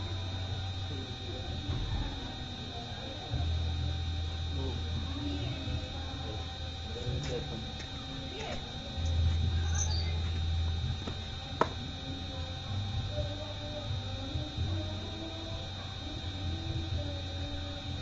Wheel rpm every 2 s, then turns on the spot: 0, 0, 0, 0, 0, 0, 0, 0, 0.
none